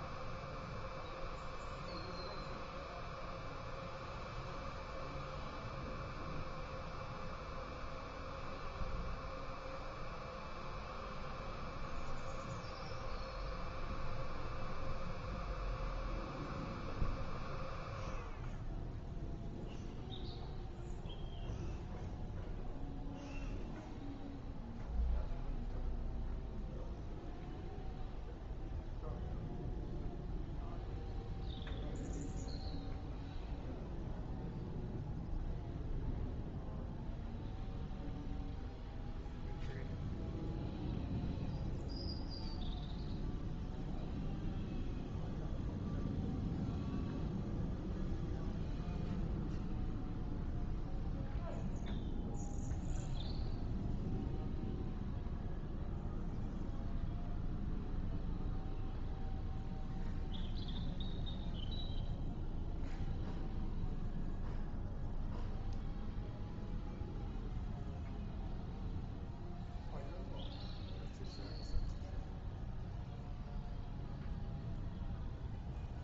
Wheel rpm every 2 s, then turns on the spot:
0, 0, 0, 0, 0, 0, 0, 0, 0, 0, 0, 0, 0, 0, 0, 0, 0, 0, 0, 0, 0, 0, 0, 0, 0, 0, 0, 0, 0, 0, 0, 0, 0, 0, 0, 0, 0, 0.
none